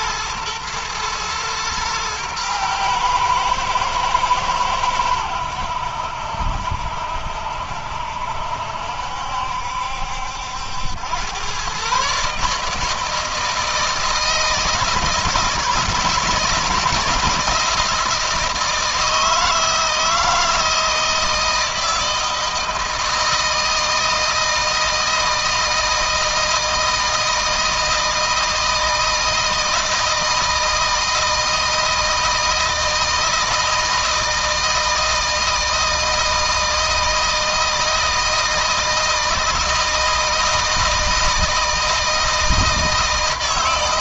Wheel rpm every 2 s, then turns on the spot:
110, 110, 100, 70, 70, 90, 160, 160, 160, 160, 170, 160, 160, 160, 160, 160, 160, 160, 160, 160, 160, 160.
none